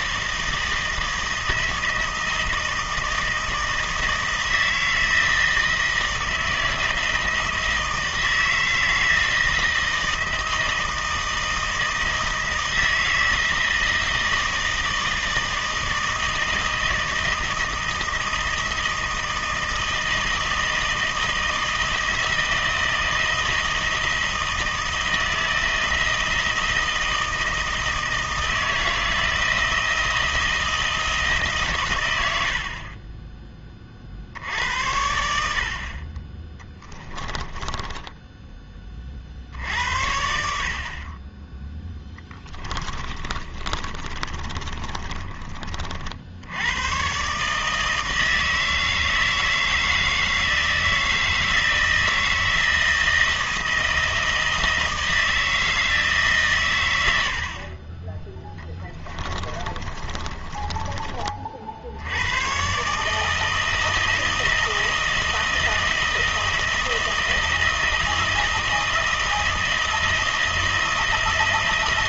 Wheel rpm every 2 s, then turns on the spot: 160, 160, 160, 160, 160, 160, 160, 160, 160, 160, 160, 160, 160, 160, 160, 160, 50, 80, 20, 30, 50, 20, 20, 100, 160, 160, 160, 160, 110, 20, 30, 140, 160, 160, 160, 160.
42-46 58-62